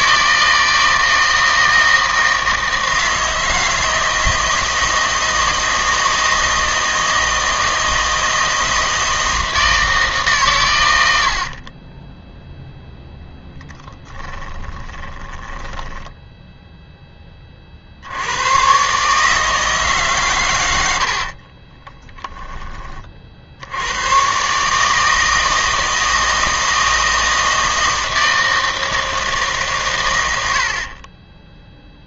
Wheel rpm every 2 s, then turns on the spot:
160, 160, 160, 160, 160, 130, 0, 20, 0, 110, 100, 20, 140, 160, 160, 70.
14-16